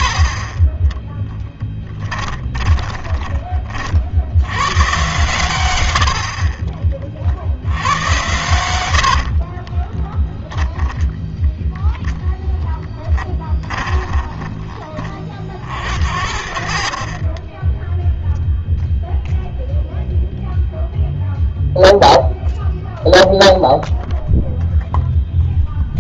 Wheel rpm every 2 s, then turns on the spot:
20, 20, 120, 30, 100, 0, 10, 20, 70, 0, 0, 0, 0.
2-4 14-18